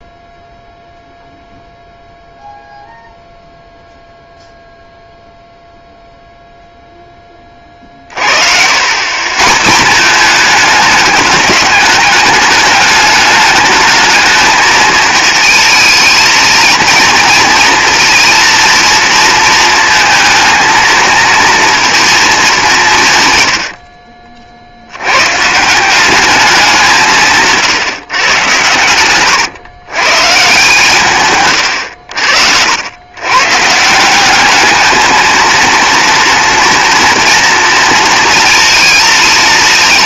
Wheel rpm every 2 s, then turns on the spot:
0, 0, 0, 0, 100, 210, 210, 220, 230, 230, 230, 170, 80, 190, 100, 150, 90, 220, 240, 230.
none